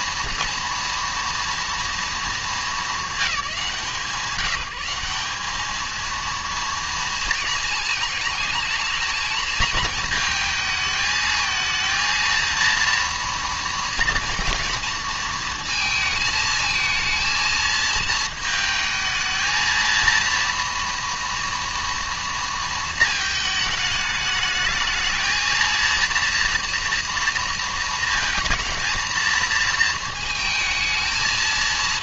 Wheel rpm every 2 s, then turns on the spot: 230, 220, 190, 230, 220, 220, 230, 230, 220, 220, 230, 230, 220, 230, 230, 230.
none